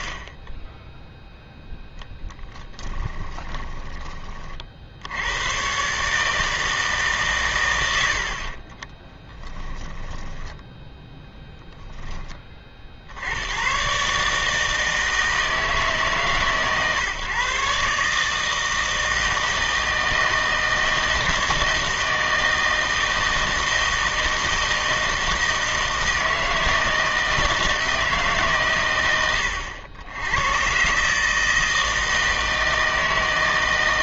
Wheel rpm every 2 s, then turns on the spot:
10, 20, 50, 150, 30, 20, 50, 160, 140, 160, 160, 160, 160, 160, 100, 110, 160.
0-4 8-12